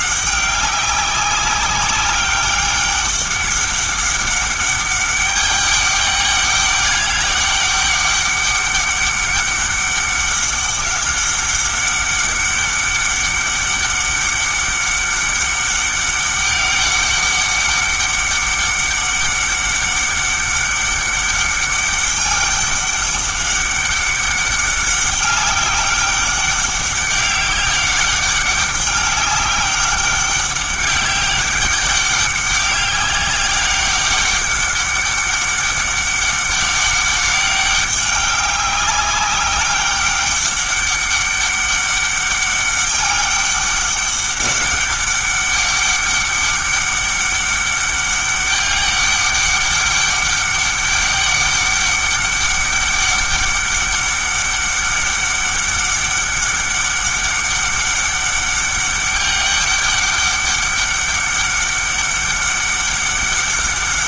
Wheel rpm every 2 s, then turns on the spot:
190, 200, 200, 200, 200, 190, 200, 200, 200, 200, 200, 200, 200, 200, 200, 200, 190, 200, 200, 200, 200, 200, 200, 200, 200, 200, 200, 200, 200, 200, 200, 200.
none